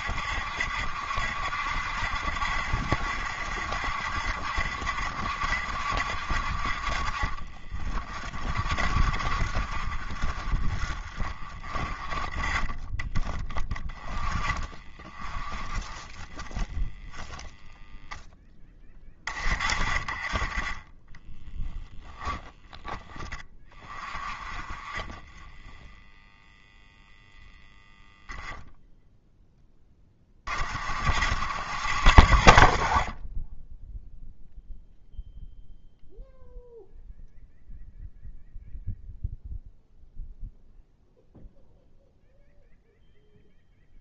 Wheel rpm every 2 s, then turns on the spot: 70, 70, 70, 60, 50, 50, 20, 30, 20, 10, 30, 10, 30, 0, 0, 40, 70, 0, 0, 0, 0, 0.
none